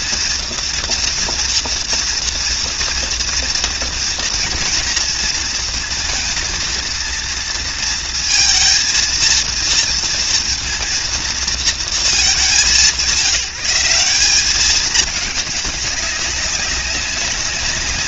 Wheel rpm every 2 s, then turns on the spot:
230, 230, 230, 230, 230, 230, 160, 210, 200.
none